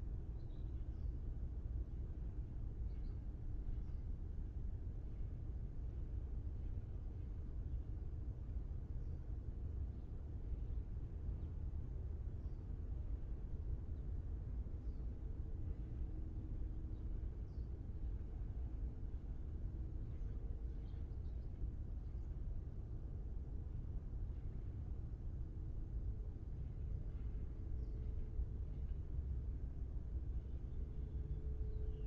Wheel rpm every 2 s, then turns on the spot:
0, 0, 0, 0, 0, 0, 0, 0, 0, 0, 0, 0, 0, 0, 0, 0.
none